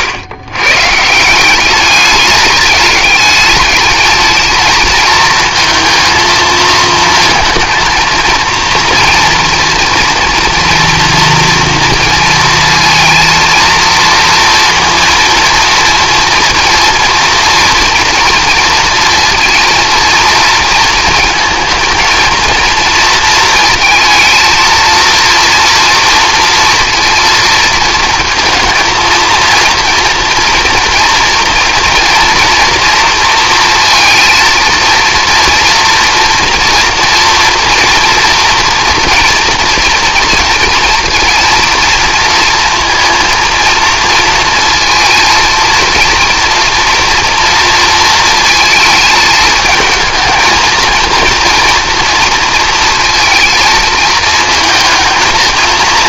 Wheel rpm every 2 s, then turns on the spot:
120, 210, 220, 230, 230, 240, 230, 240, 230, 230, 230, 230, 230, 230, 220, 230, 230, 230, 230, 230, 230, 230, 230, 230, 230, 230, 230, 220.
none